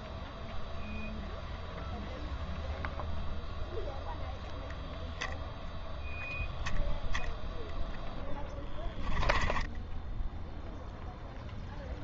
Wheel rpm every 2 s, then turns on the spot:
0, 0, 0, 0, 10, 0.
8-10